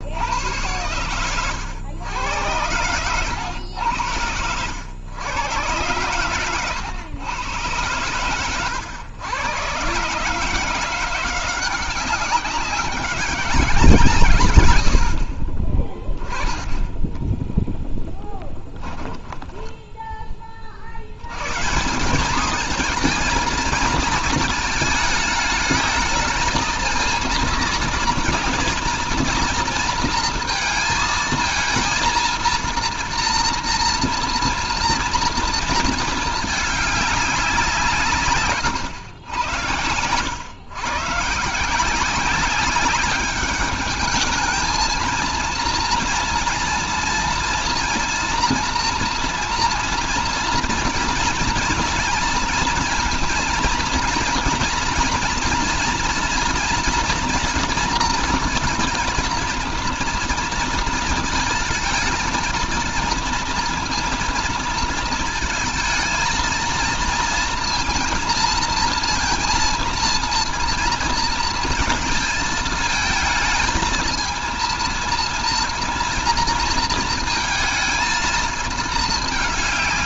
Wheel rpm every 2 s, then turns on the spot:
100, 100, 90, 120, 120, 170, 190, 100, 20, 20, 50, 210, 220, 220, 230, 230, 230, 230, 210, 120, 120, 200, 220, 230, 240, 230, 230, 230, 230, 230, 230, 230, 230, 230, 230, 230, 220, 230, 230, 220.
16-20 38-40